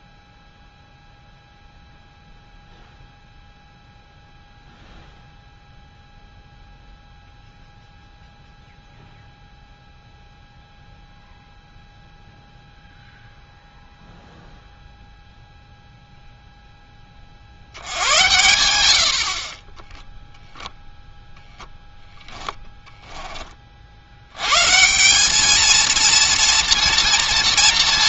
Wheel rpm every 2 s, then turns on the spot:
0, 0, 0, 0, 0, 0, 0, 0, 10, 100, 0, 10, 140, 230.
22-24